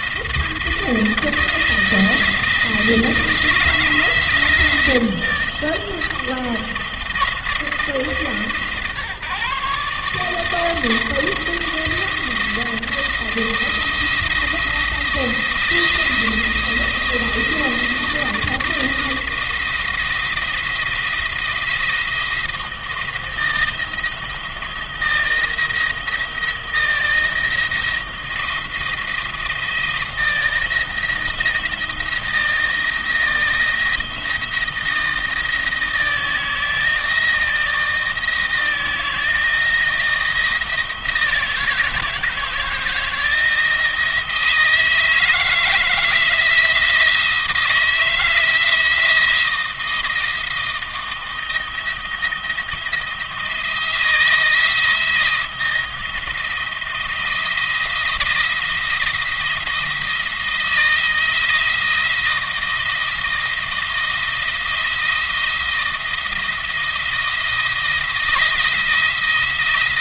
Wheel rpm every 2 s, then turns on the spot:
160, 160, 170, 170, 150, 160, 170, 170, 170, 170, 170, 170, 170, 170, 170, 170, 170, 170, 160, 160, 160, 160, 170, 170, 170, 160, 170, 160, 160, 170, 160, 170, 170, 170, 170.
none